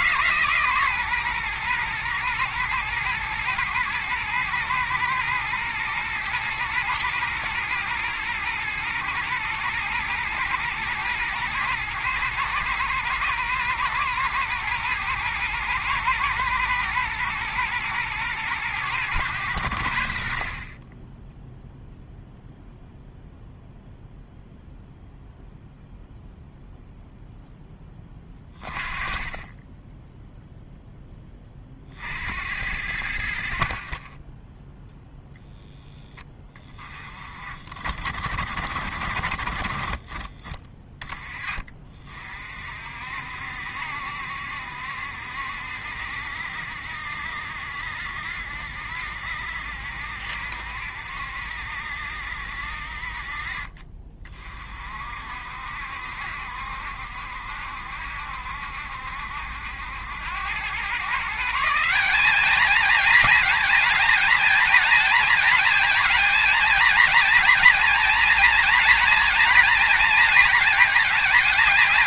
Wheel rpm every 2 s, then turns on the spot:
140, 120, 110, 120, 110, 120, 110, 110, 120, 110, 30, 0, 0, 0, 30, 0, 80, 0, 30, 60, 30, 50, 70, 70, 70, 70, 50, 50, 70, 70, 110, 220, 230, 230, 230, 230.
none